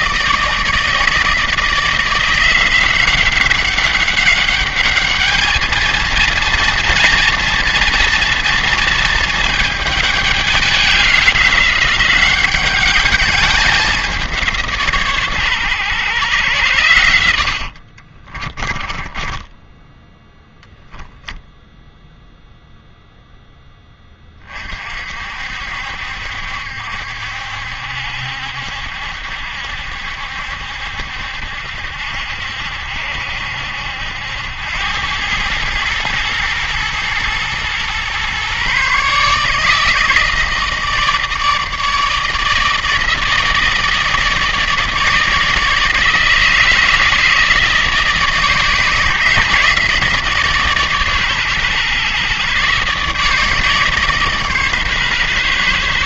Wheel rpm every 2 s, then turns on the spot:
160, 180, 200, 230, 230, 200, 200, 150, 100, 20, 10, 0, 40, 70, 70, 70, 70, 90, 110, 130, 160, 160, 160, 160, 160, 140, 140, 140.
18-20